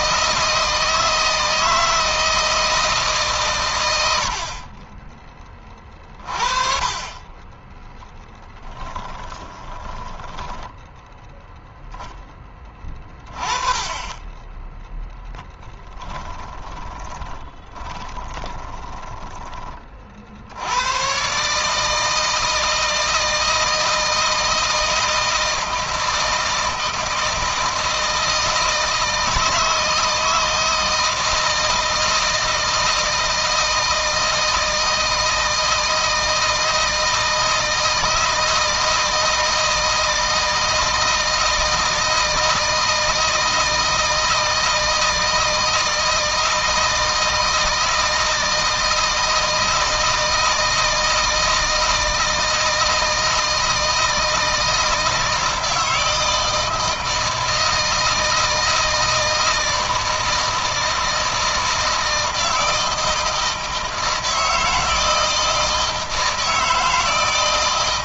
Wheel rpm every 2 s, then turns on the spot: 160, 160, 30, 20, 10, 10, 20, 10, 20, 10, 100, 160, 160, 160, 160, 160, 160, 160, 160, 160, 160, 160, 160, 160, 160, 160, 160, 160, 160, 160, 160, 160, 160, 160.
8-10 16-20